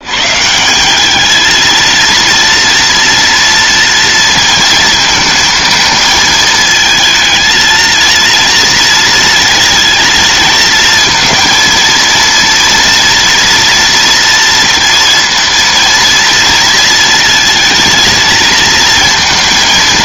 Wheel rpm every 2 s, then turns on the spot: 200, 230, 230, 220, 230, 230, 230, 230, 230, 230.
none